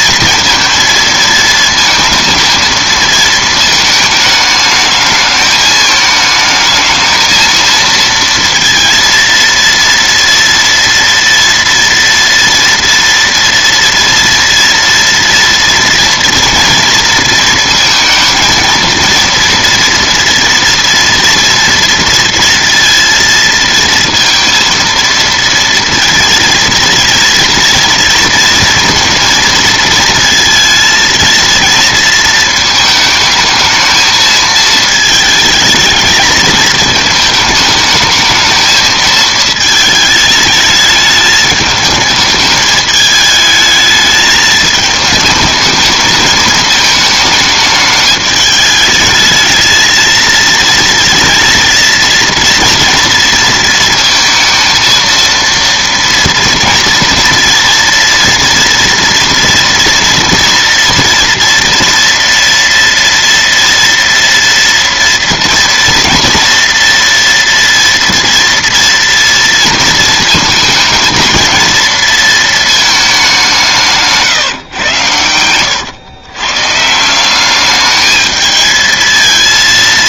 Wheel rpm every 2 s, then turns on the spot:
230, 230, 220, 220, 220, 230, 230, 240, 230, 220, 230, 230, 230, 230, 230, 230, 230, 220, 220, 210, 220, 220, 220, 220, 210, 220, 220, 230, 230, 230, 230, 230, 230, 230, 230, 230, 230, 170, 120, 210.
none